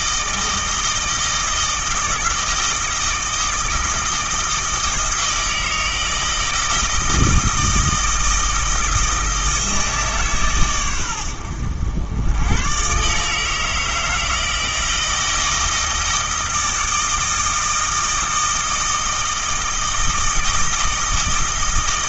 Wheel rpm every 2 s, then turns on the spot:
160, 160, 160, 160, 160, 120, 120, 160, 160, 160, 160.
none